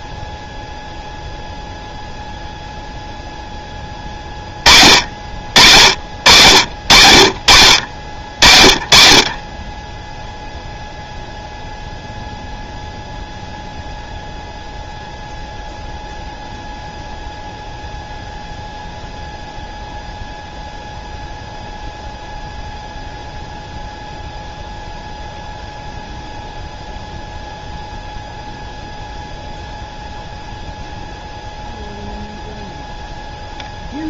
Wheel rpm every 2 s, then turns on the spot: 0, 0, 50, 50, 50, 0, 0, 0, 0, 0, 0, 0, 0, 0, 0, 0, 0.
none